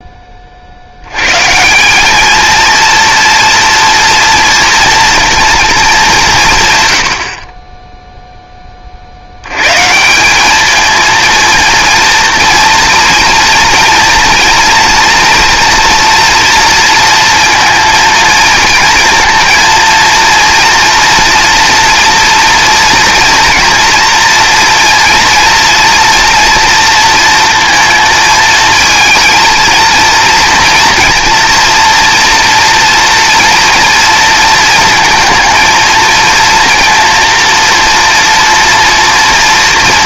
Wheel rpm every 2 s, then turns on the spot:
60, 230, 230, 140, 30, 210, 230, 230, 230, 230, 230, 240, 230, 230, 220, 230, 230, 230, 230, 230.
none